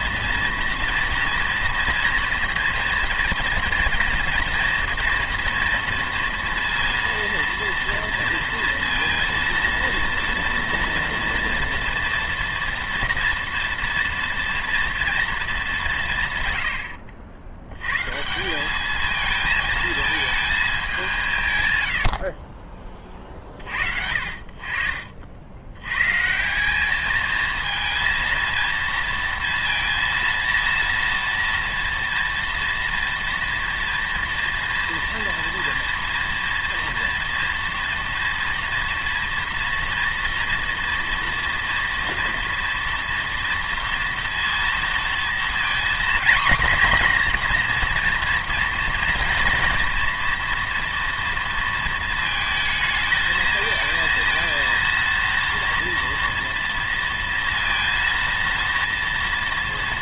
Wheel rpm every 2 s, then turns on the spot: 240, 230, 240, 230, 230, 230, 230, 230, 100, 200, 200, 20, 50, 200, 230, 230, 230, 230, 230, 230, 230, 230, 230, 250, 240, 230, 220, 230, 230, 230.
none